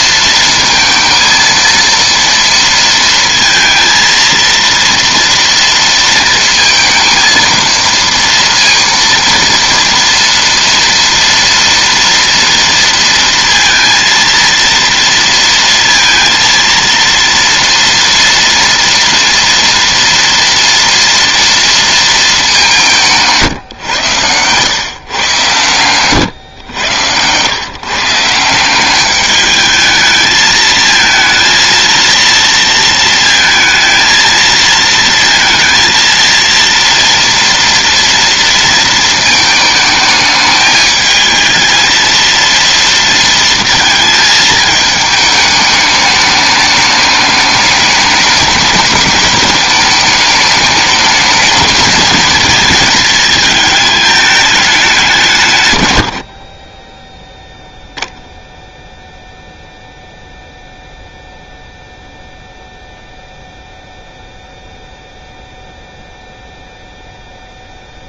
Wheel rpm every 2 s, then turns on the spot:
230, 230, 230, 230, 230, 230, 230, 230, 230, 230, 230, 180, 120, 110, 190, 220, 230, 230, 230, 230, 220, 230, 210, 210, 210, 210, 220, 200, 20, 0, 0, 0, 0, 0.
none